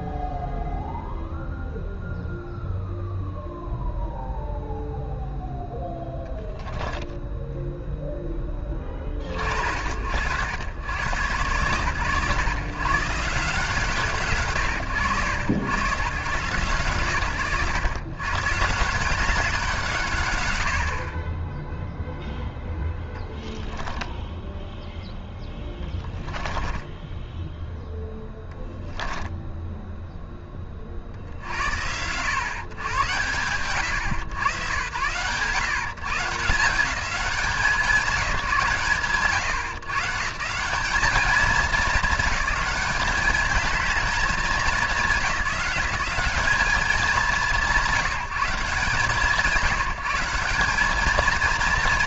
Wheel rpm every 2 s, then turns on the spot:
0, 0, 0, 0, 30, 110, 130, 110, 110, 150, 40, 0, 10, 10, 10, 20, 110, 100, 190, 140, 200, 200, 190, 200, 160, 190.
26-28